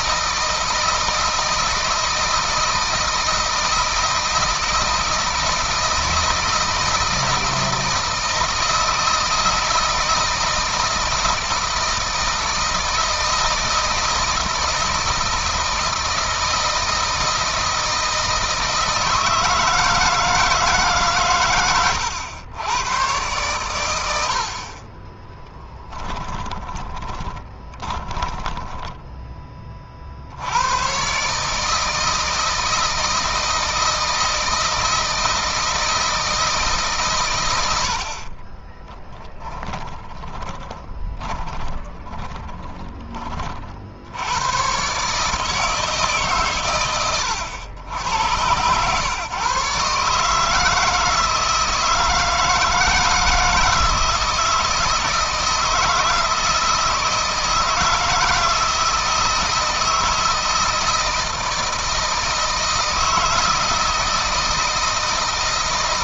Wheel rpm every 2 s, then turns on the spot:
160, 160, 160, 160, 160, 160, 160, 160, 160, 160, 150, 110, 40, 20, 10, 120, 160, 160, 150, 30, 20, 20, 130, 110, 110, 160, 160, 160, 160, 160, 160, 160, 160.
26-30 38-42